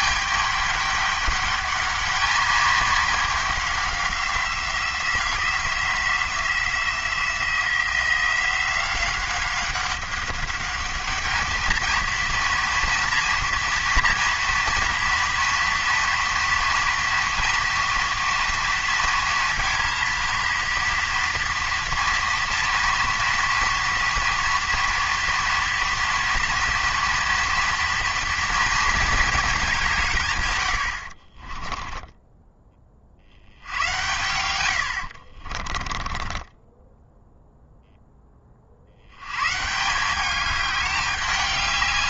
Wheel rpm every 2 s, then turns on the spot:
200, 210, 180, 170, 180, 200, 230, 240, 230, 230, 230, 230, 230, 230, 230, 70, 20, 80, 10, 70, 210.
36-38